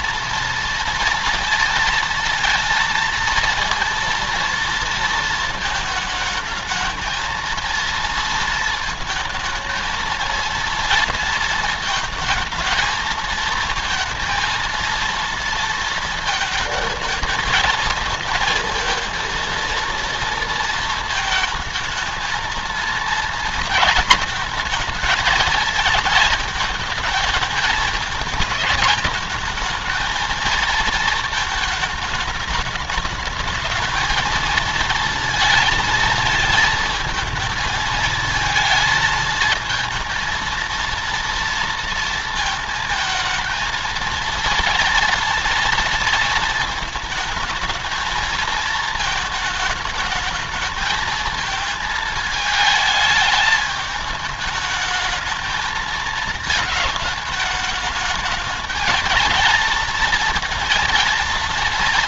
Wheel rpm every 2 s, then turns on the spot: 230, 230, 230, 220, 230, 230, 230, 230, 230, 220, 230, 230, 220, 220, 210, 220, 210, 230, 230, 220, 230, 230, 230, 230, 220, 210, 220, 210, 220, 220, 230.
none